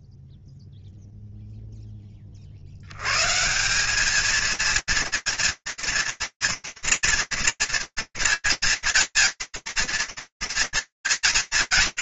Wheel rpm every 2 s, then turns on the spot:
0, 180, 230, 230, 230, 230.
none